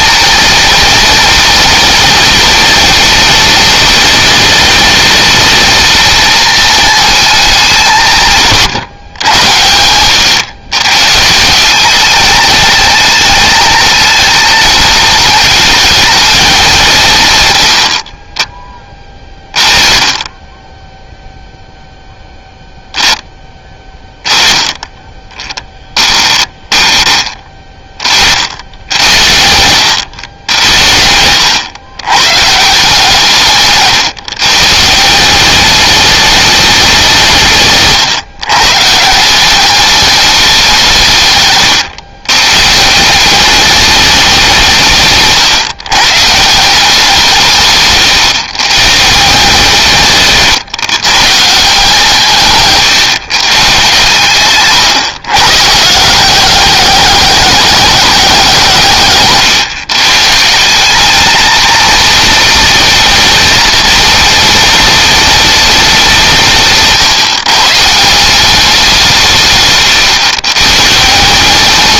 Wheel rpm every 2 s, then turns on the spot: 230, 220, 220, 220, 130, 130, 220, 210, 170, 20, 10, 0, 10, 20, 80, 80, 150, 160, 190, 150, 170, 160, 150, 180, 140, 130, 140, 140, 200, 170, 200, 230, 210, 150, 180, 150.
none